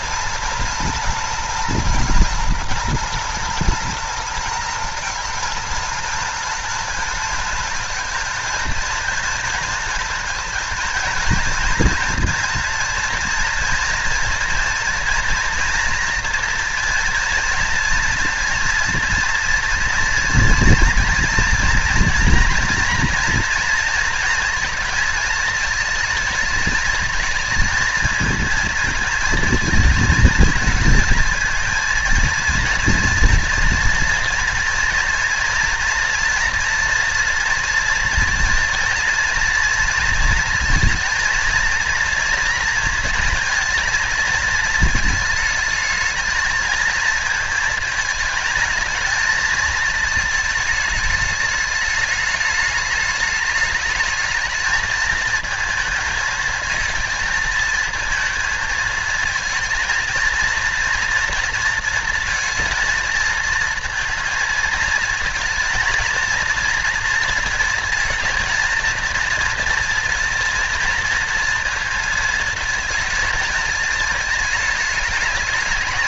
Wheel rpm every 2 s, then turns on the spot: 230, 230, 230, 230, 230, 220, 230, 230, 230, 230, 230, 240, 230, 220, 230, 220, 230, 230, 240, 240, 230, 230, 220, 220, 220, 220, 210, 220, 220, 230, 230, 220, 230, 240, 230, 230, 230, 220.
none